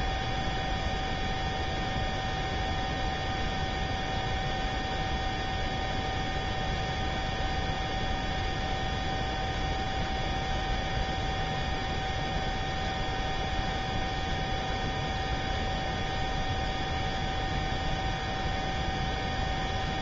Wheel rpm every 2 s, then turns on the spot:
0, 0, 0, 0, 0, 0, 0, 0, 0, 0.
none